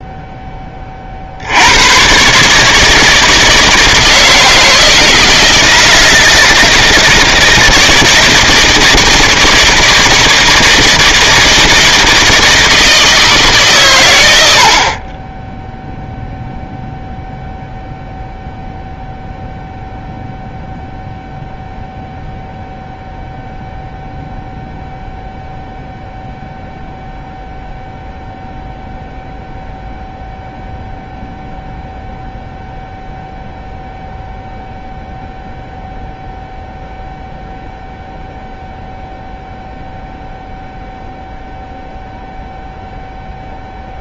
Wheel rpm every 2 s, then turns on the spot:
20, 150, 160, 160, 160, 160, 160, 60, 0, 0, 0, 0, 0, 0, 0, 0, 0, 0, 0, 0, 0, 0.
none